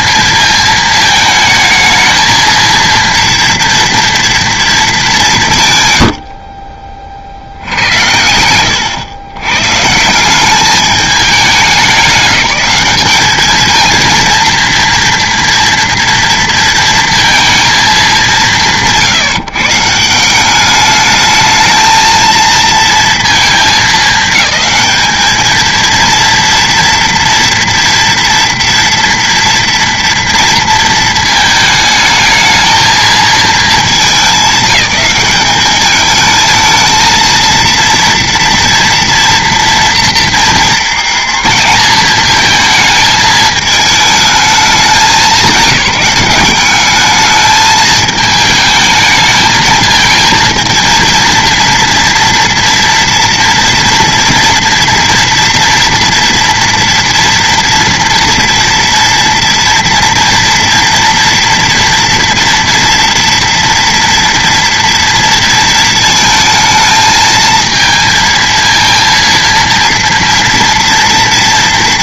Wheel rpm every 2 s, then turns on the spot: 220, 220, 230, 40, 110, 200, 200, 230, 230, 180, 190, 230, 210, 230, 230, 230, 220, 190, 220, 230, 230, 220, 220, 200, 220, 230, 240, 230, 230, 230, 230, 230, 230, 220, 230, 230.
8-10